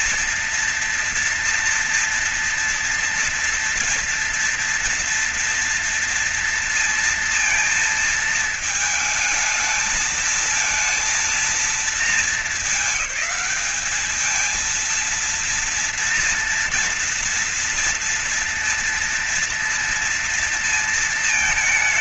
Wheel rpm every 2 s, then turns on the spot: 240, 240, 230, 230, 220, 230, 190, 230, 230, 230, 230.
none